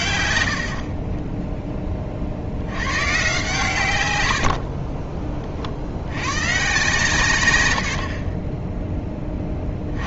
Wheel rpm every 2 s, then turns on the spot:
60, 90, 50, 130, 20.
4-6 8-10